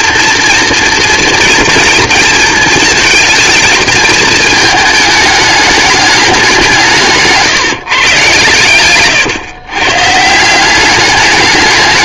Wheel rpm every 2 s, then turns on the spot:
230, 230, 220, 190, 120, 160.
none